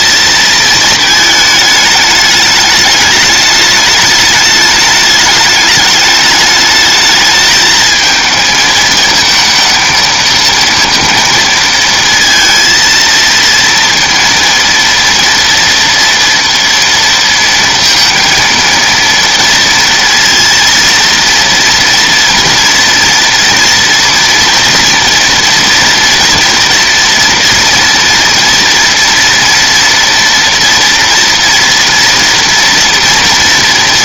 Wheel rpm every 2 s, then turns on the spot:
230, 210, 210, 210, 220, 220, 230, 230, 230, 230, 230, 230, 230, 240, 230, 230, 230.
none